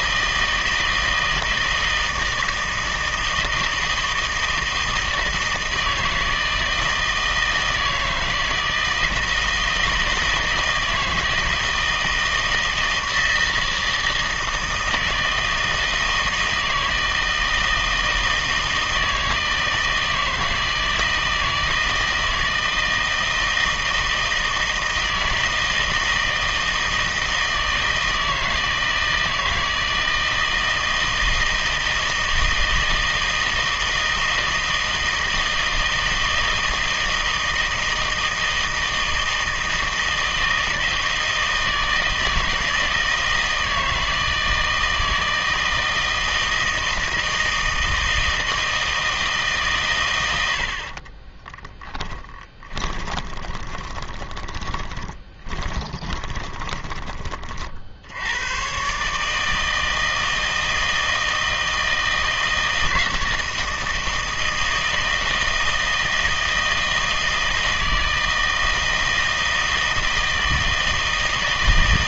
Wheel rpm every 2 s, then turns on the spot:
160, 160, 160, 160, 160, 160, 160, 160, 160, 160, 160, 160, 160, 160, 160, 160, 160, 160, 160, 160, 160, 160, 160, 160, 160, 70, 20, 20, 20, 120, 160, 160, 160, 160, 160, 160.
52-58